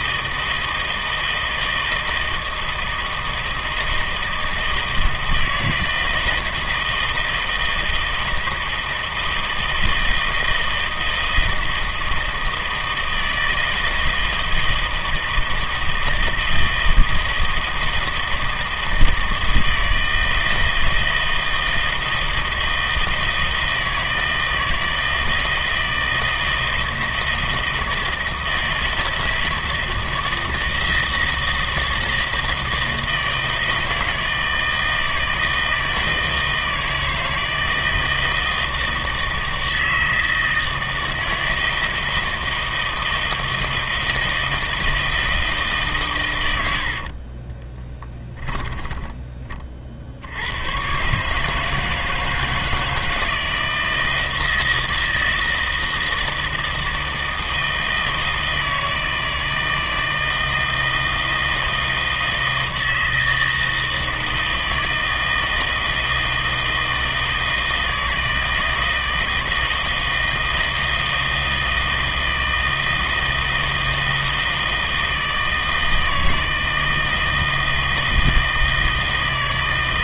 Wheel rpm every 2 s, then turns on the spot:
160, 160, 160, 160, 160, 160, 160, 160, 160, 160, 160, 160, 160, 160, 160, 160, 160, 160, 160, 160, 160, 160, 160, 70, 10, 110, 160, 160, 160, 160, 160, 160, 160, 160, 160, 160, 160, 160, 160, 160.
46-50